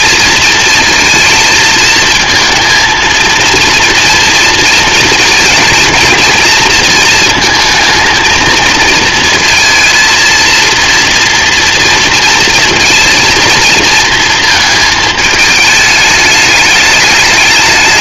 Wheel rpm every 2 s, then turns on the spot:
230, 230, 230, 230, 230, 230, 230, 220, 210.
none